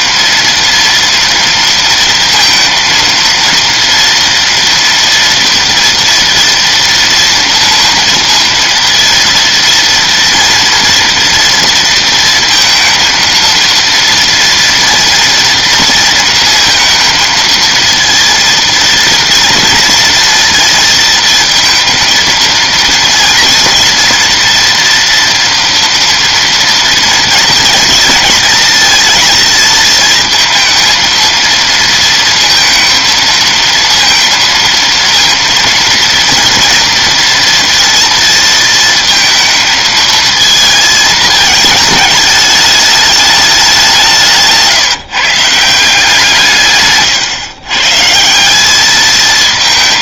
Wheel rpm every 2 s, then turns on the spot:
230, 230, 230, 230, 230, 230, 230, 230, 230, 230, 230, 230, 240, 230, 230, 230, 230, 230, 230, 220, 220, 210, 170, 140, 190.
none